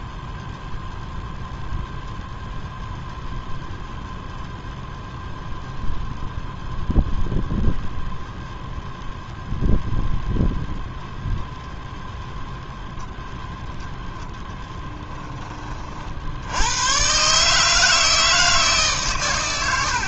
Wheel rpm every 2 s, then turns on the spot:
0, 0, 0, 0, 0, 0, 0, 10, 110, 140.
none